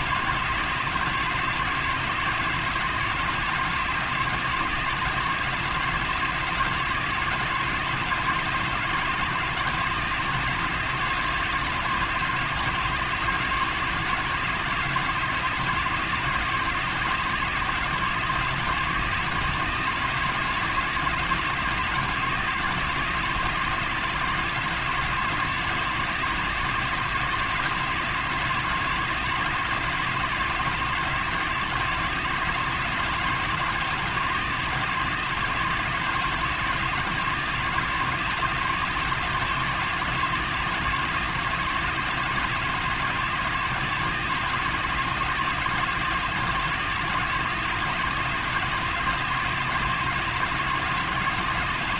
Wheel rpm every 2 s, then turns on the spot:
160, 170, 160, 170, 160, 170, 160, 160, 160, 160, 160, 170, 160, 170, 170, 160, 160, 170, 160, 160, 160, 160, 160, 160, 170, 160.
none